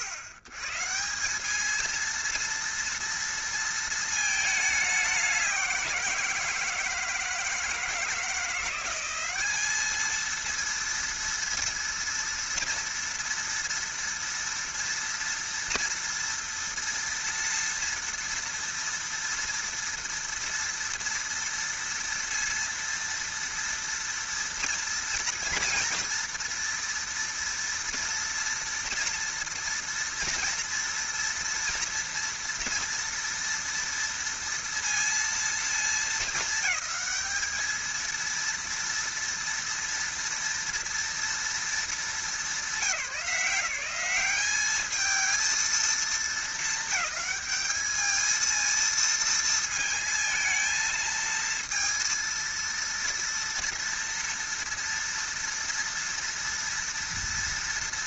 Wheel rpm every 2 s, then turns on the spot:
120, 230, 210, 160, 180, 230, 230, 230, 230, 230, 230, 230, 230, 230, 230, 230, 230, 230, 210, 230, 230, 190, 200, 220, 220, 220, 230, 230, 230.
none